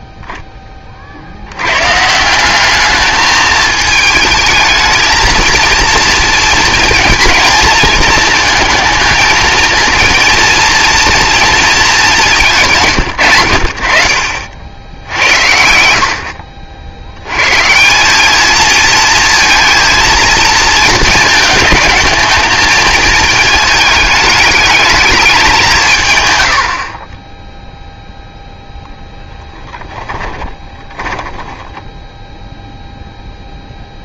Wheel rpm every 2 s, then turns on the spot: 10, 200, 220, 230, 220, 230, 160, 60, 60, 220, 230, 230, 210, 70, 0, 20, 0.
14-18 30-32